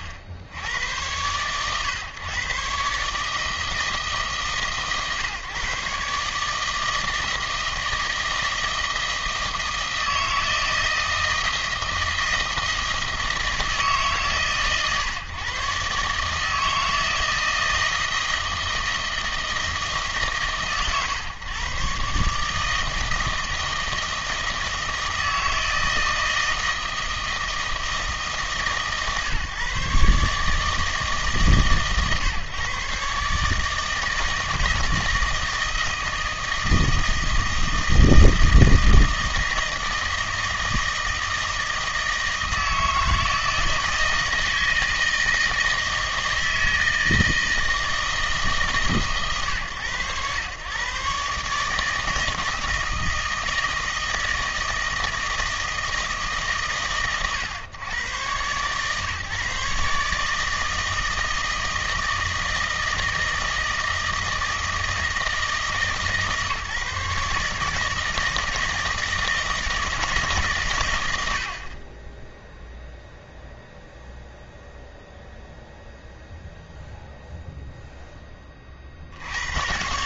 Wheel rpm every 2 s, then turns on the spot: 80, 140, 140, 160, 160, 160, 160, 130, 160, 160, 130, 150, 160, 160, 150, 150, 140, 160, 160, 160, 160, 160, 160, 160, 150, 110, 160, 160, 120, 120, 160, 160, 160, 140, 160, 130, 0, 0, 0, 40.
none